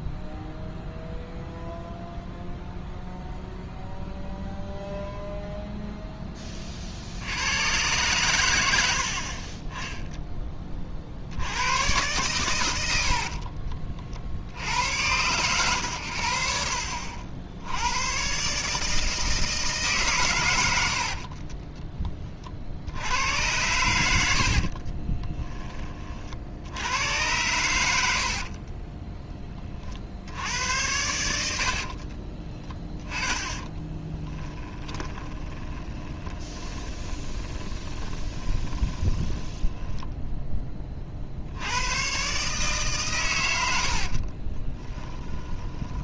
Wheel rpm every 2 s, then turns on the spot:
0, 0, 0, 50, 80, 30, 100, 80, 70, 160, 80, 70, 50, 80, 30, 80, 20, 10, 20, 10, 20, 140, 30.
24-26 32-40 44-46